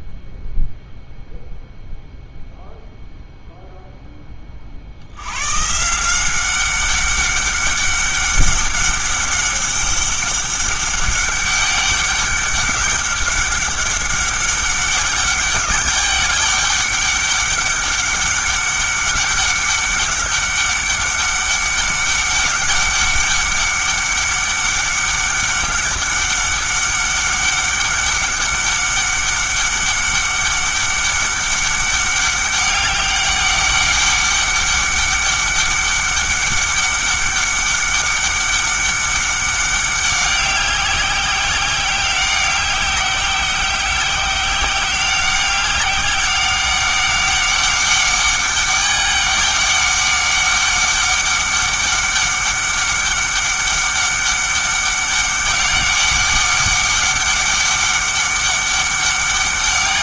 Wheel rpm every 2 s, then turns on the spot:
0, 0, 50, 190, 200, 200, 200, 200, 200, 200, 200, 200, 200, 200, 200, 200, 200, 200, 200, 200, 200, 190, 190, 200, 200, 200, 200, 200, 200, 200.
none